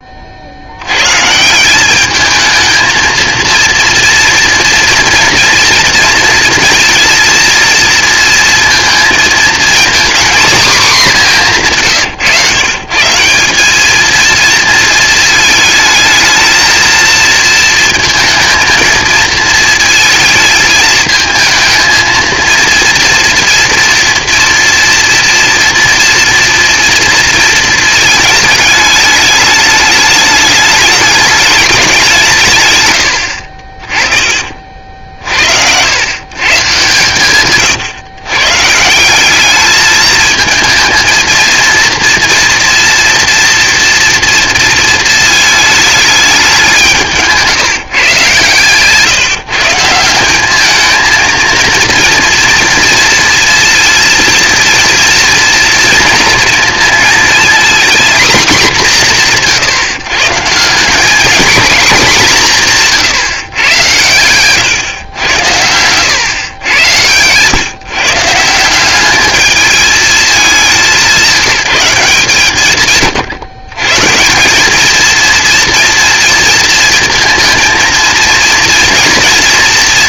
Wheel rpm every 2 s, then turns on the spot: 70, 220, 230, 230, 230, 240, 130, 230, 220, 220, 220, 230, 230, 230, 220, 210, 140, 50, 140, 140, 220, 230, 230, 190, 130, 200, 230, 240, 230, 230, 170, 180, 120, 110, 180, 190, 140, 190, 230, 230.
48-50